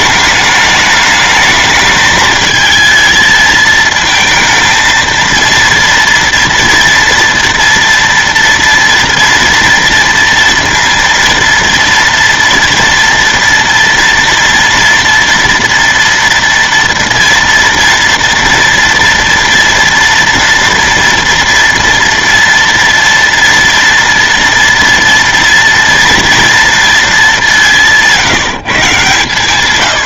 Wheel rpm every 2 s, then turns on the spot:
210, 220, 230, 230, 230, 230, 230, 230, 230, 230, 230, 240, 230, 230, 150.
none